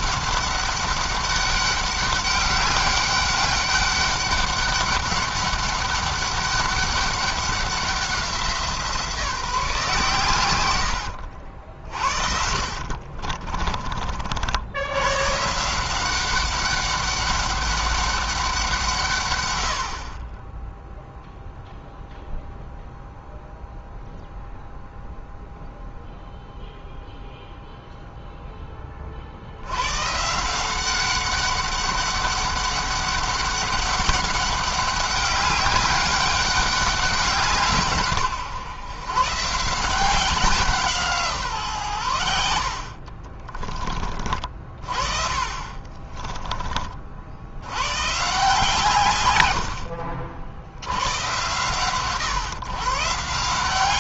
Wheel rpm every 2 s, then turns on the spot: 200, 200, 200, 200, 170, 110, 40, 90, 190, 170, 10, 0, 0, 0, 10, 180, 200, 200, 200, 130, 180, 70, 40, 30, 140, 70, 130.
10-14 42-44